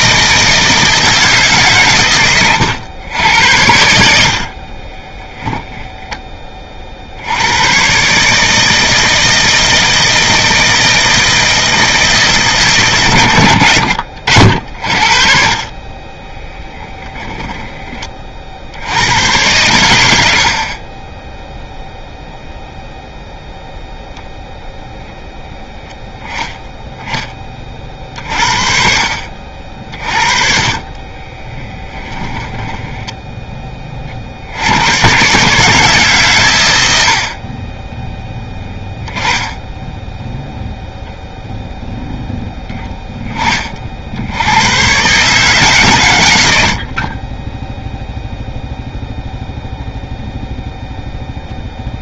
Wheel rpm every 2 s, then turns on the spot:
160, 100, 30, 30, 160, 160, 140, 60, 10, 50, 50, 0, 0, 10, 50, 40, 10, 70, 100, 10, 0, 10, 100, 80, 0, 0.
4-6 16-18 30-34 46-48